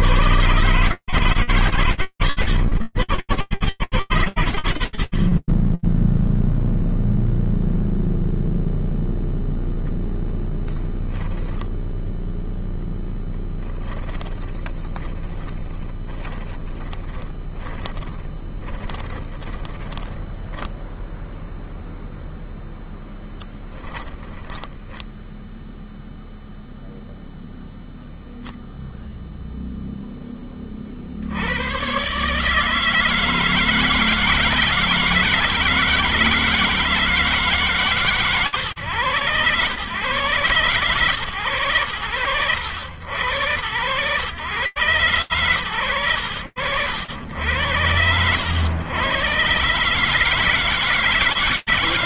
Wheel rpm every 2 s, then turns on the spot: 100, 130, 60, 0, 0, 10, 20, 20, 10, 20, 0, 10, 30, 0, 0, 60, 160, 160, 160, 110, 120, 90, 120, 80, 120, 150.
12-20 22-26